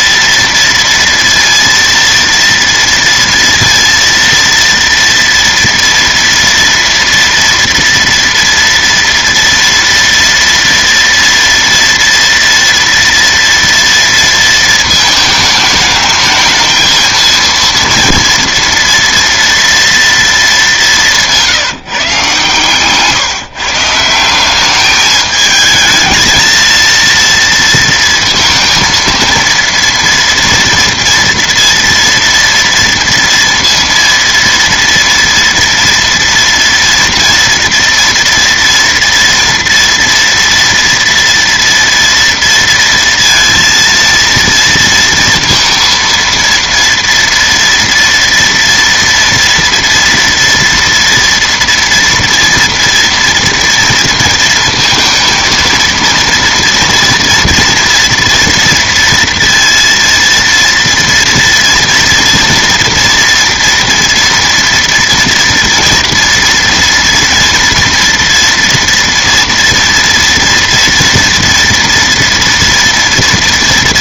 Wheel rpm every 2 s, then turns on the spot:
230, 230, 230, 230, 230, 230, 240, 220, 220, 230, 200, 130, 190, 230, 230, 230, 230, 230, 230, 230, 230, 230, 230, 230, 230, 230, 230, 230, 230, 230, 230, 240, 230, 230, 230, 240, 230.
22-24